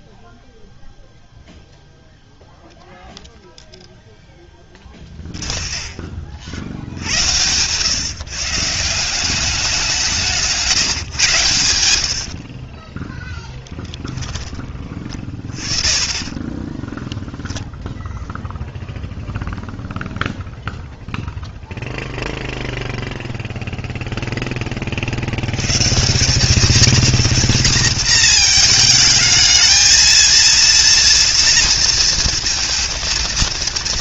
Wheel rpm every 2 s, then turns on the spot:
0, 0, 20, 80, 170, 150, 10, 30, 10, 0, 0, 0, 50, 220, 220, 230, 230.
4-6 12-14 16-18